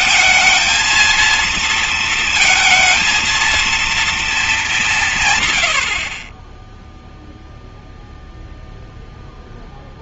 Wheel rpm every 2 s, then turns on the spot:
220, 220, 200, 20, 0.
none